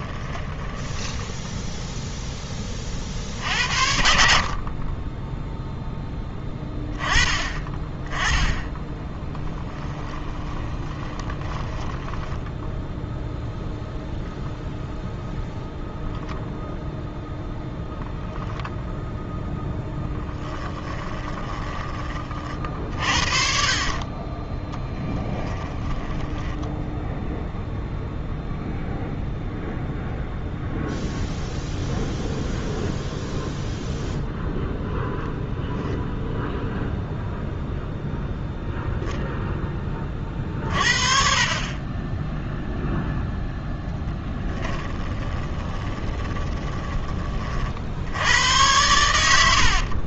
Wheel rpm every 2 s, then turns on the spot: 20, 30, 30, 10, 10, 10, 0, 0, 0, 0, 10, 50, 20, 0, 0, 0, 0, 0, 0, 0, 40, 0, 10, 20, 100.
0-2 10-12 20-22 24-26 44-48